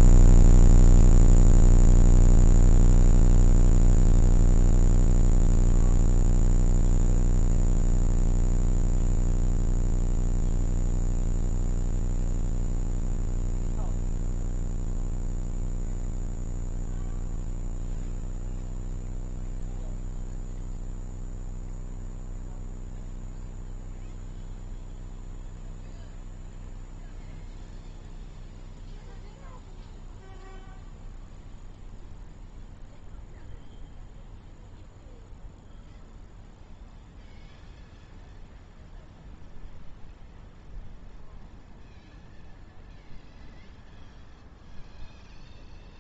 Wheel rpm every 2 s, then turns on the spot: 0, 0, 0, 0, 0, 0, 0, 0, 0, 0, 0, 0, 0, 0, 0, 0, 0, 0, 0, 0, 0, 0, 0.
none